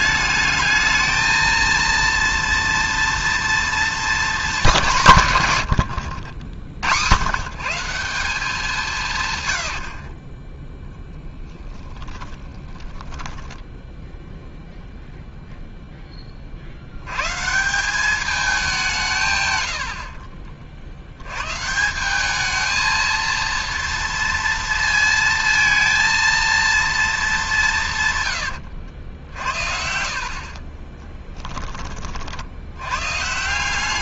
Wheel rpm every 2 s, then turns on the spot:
220, 230, 210, 100, 170, 10, 10, 0, 150, 110, 150, 230, 230, 190, 70, 20, 170.
12-14 28-30